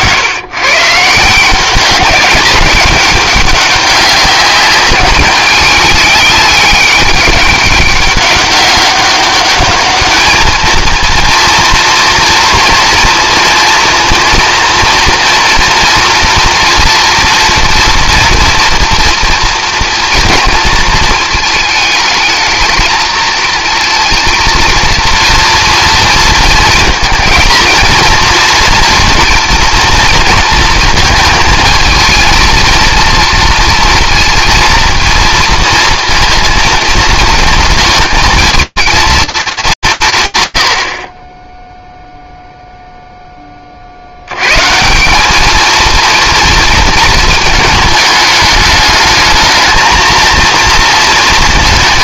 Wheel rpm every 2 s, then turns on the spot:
130, 200, 190, 200, 200, 220, 230, 240, 230, 230, 230, 220, 230, 230, 230, 230, 230, 230, 230, 220, 90, 0, 110, 230, 210, 230.
none